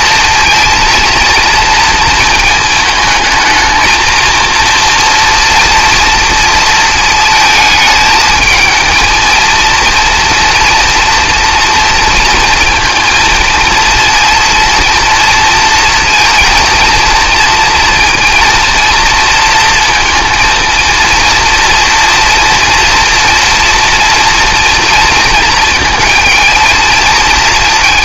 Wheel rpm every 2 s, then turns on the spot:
230, 230, 230, 230, 220, 230, 230, 230, 230, 230, 230, 240, 230, 220.
none